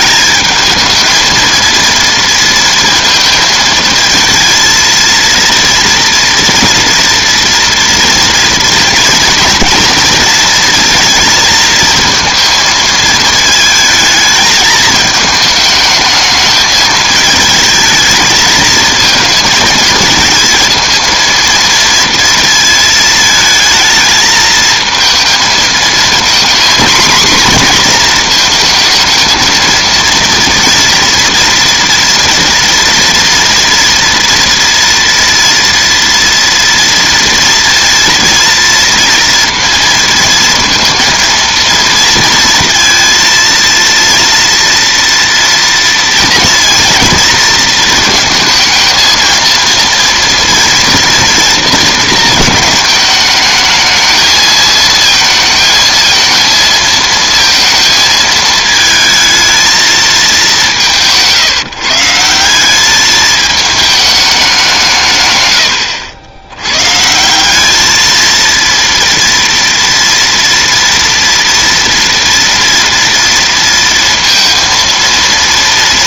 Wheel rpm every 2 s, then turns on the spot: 220, 230, 230, 230, 230, 230, 220, 220, 220, 220, 230, 220, 220, 240, 220, 240, 230, 240, 230, 230, 230, 230, 230, 230, 230, 230, 220, 220, 220, 220, 170, 200, 160, 120, 230, 230, 230, 230.
none